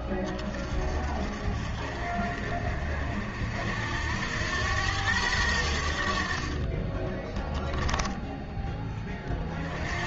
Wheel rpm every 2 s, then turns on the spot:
40, 50, 100, 20, 20.
none